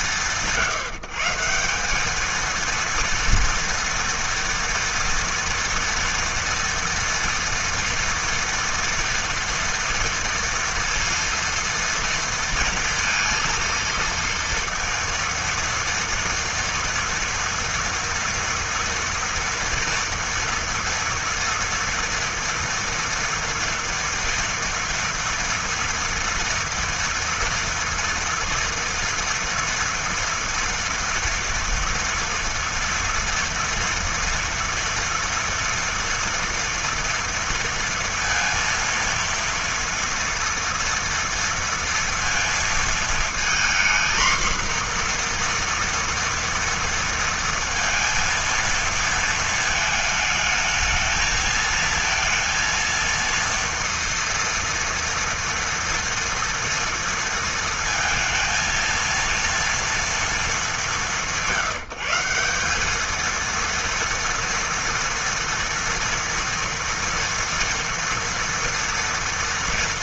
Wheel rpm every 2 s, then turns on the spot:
170, 230, 230, 230, 230, 230, 230, 230, 230, 230, 230, 230, 230, 230, 230, 230, 230, 230, 230, 230, 230, 230, 240, 230, 230, 220, 230, 230, 230, 230, 170, 220, 230, 230, 230.
none